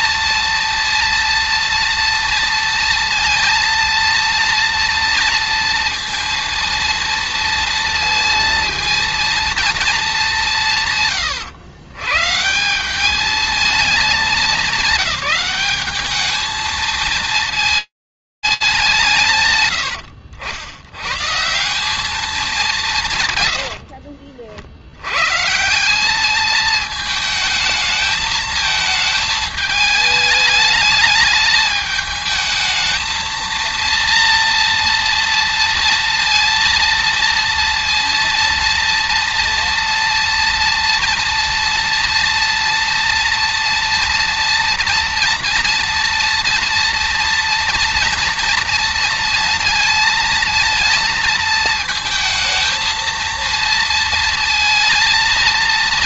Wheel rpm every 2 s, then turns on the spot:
230, 230, 230, 230, 230, 160, 170, 190, 220, 90, 140, 130, 120, 220, 220, 210, 220, 230, 230, 230, 230, 230, 230, 230, 230, 230, 230, 230.
22-24